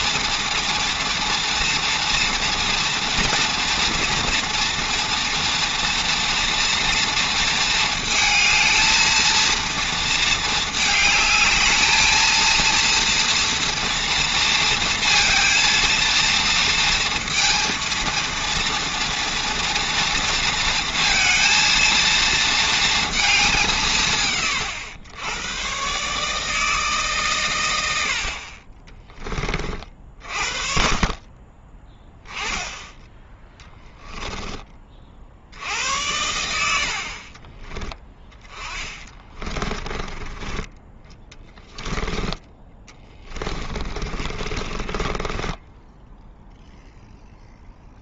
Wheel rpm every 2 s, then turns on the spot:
230, 230, 240, 240, 230, 220, 220, 230, 230, 230, 230, 230, 120, 150, 50, 50, 10, 10, 80, 20, 20, 10, 30, 0.
38-46